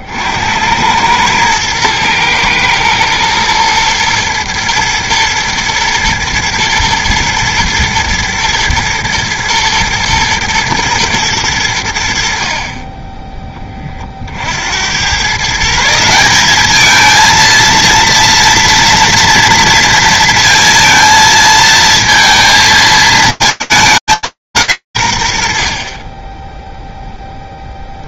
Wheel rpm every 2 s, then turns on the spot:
100, 120, 120, 120, 110, 120, 20, 100, 220, 230, 230, 220, 160, 10.
none